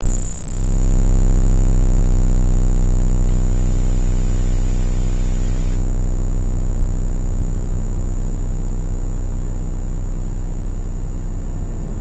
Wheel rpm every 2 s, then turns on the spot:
0, 0, 0, 0, 0, 0.
none